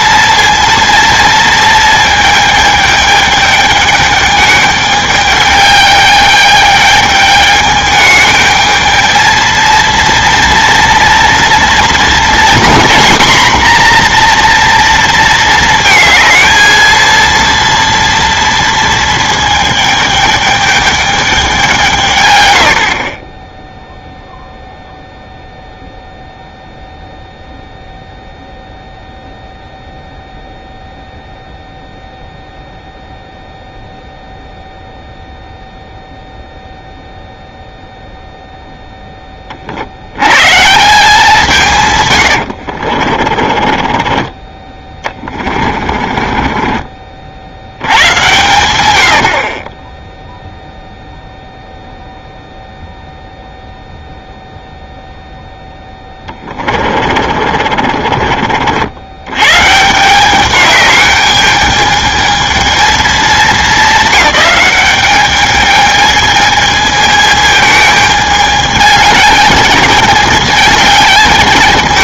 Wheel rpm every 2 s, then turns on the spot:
230, 220, 210, 210, 220, 230, 240, 240, 220, 230, 210, 80, 0, 0, 0, 0, 0, 0, 0, 0, 140, 80, 20, 30, 100, 0, 0, 0, 30, 60, 200, 220, 210, 220, 210, 210.
42-44 46-48 56-58